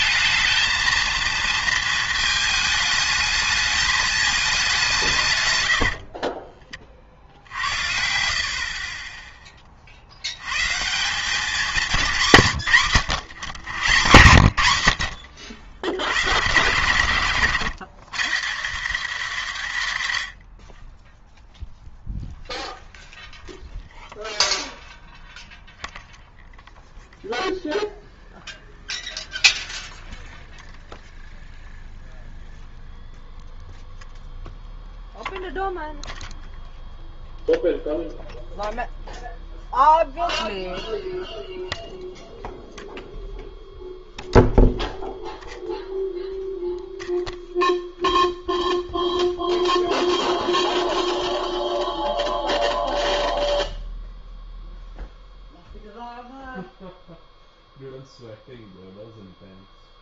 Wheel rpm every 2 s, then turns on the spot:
220, 220, 190, 30, 40, 120, 150, 90, 100, 170, 60, 0, 0, 0, 0, 0, 0, 0, 0, 0, 0, 0, 0, 0, 0, 0, 0, 0, 0, 0.
none